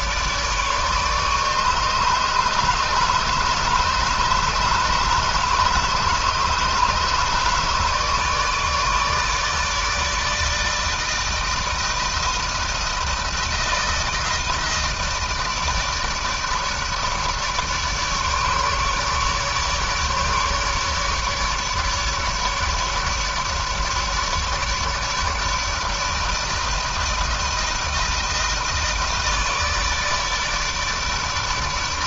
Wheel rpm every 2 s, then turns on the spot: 150, 150, 150, 150, 150, 160, 160, 160, 150, 150, 150, 150, 150, 160, 160, 150.
none